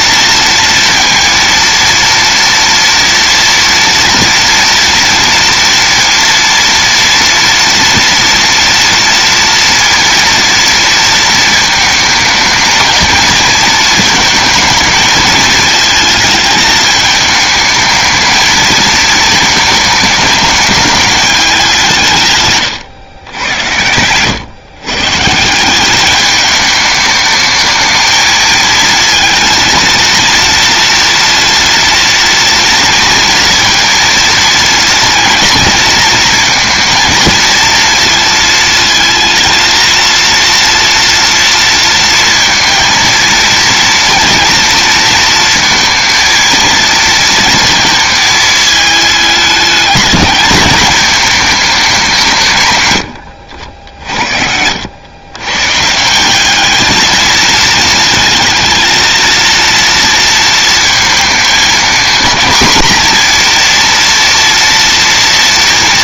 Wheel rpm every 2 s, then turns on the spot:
230, 230, 230, 230, 230, 230, 220, 220, 220, 220, 210, 110, 130, 210, 230, 230, 230, 230, 230, 230, 230, 230, 230, 220, 220, 210, 90, 110, 220, 230, 220, 240, 230.
none